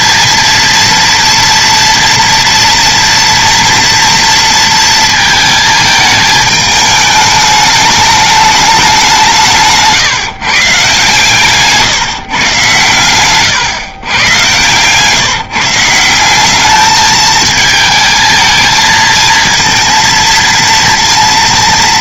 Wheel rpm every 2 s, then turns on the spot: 230, 230, 230, 210, 200, 140, 110, 130, 200, 230, 230.
14-16